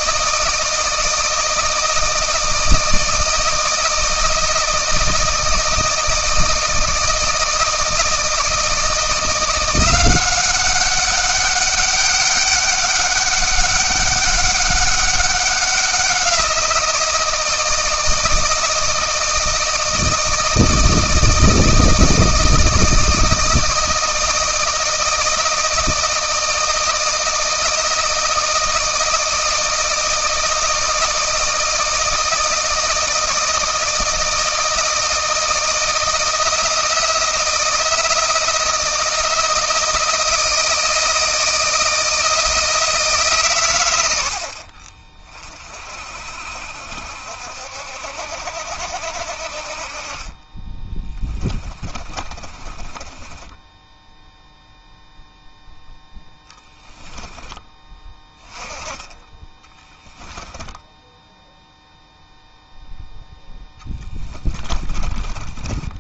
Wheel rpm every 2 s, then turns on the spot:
160, 160, 170, 160, 170, 200, 200, 200, 170, 160, 160, 160, 160, 160, 160, 160, 160, 160, 170, 160, 160, 150, 40, 60, 60, 20, 20, 0, 10, 10, 0, 0, 30.
50-54 56-58 64-66